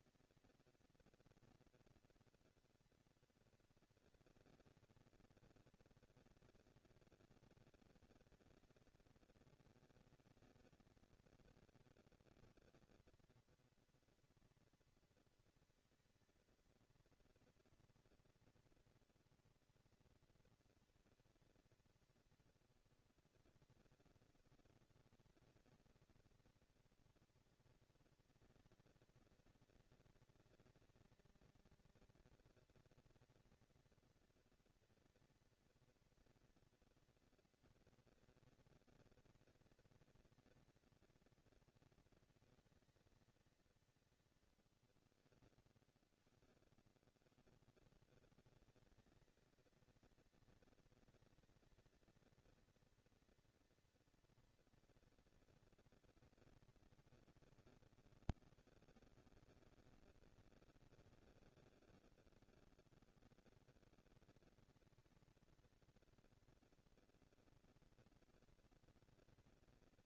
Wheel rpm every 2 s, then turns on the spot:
230, 230, 230, 230, 220, 230, 230, 230, 230, 230, 230, 210, 190, 200, 230, 230, 230, 230, 230, 230, 230, 220, 90, 50, 180, 230, 230, 240, 230, 210, 200, 210, 230, 240, 230.
none